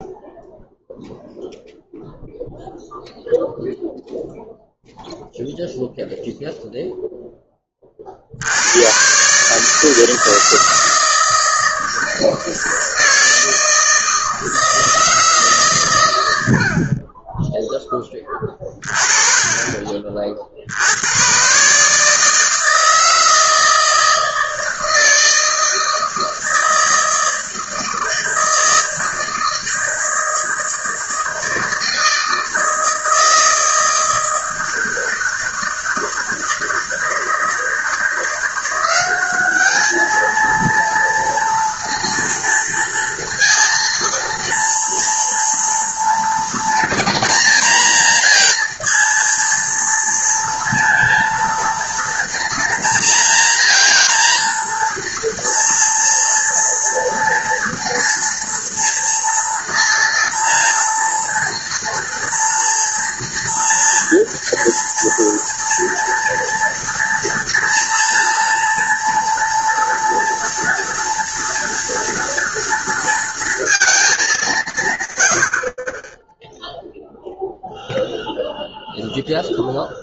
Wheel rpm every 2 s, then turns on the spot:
0, 0, 0, 0, 70, 160, 160, 160, 110, 20, 50, 150, 160, 160, 160, 160, 160, 160, 160, 170, 220, 230, 230, 240, 230, 240, 230, 230, 230, 230, 230, 230, 230, 230, 230, 230, 230, 160, 10, 20.
none